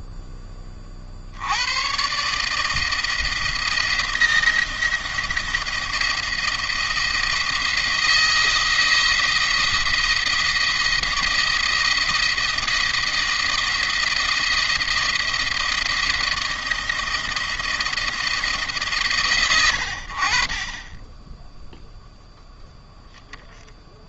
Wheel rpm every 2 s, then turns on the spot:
0, 120, 170, 160, 160, 170, 170, 170, 160, 170, 90, 0.
none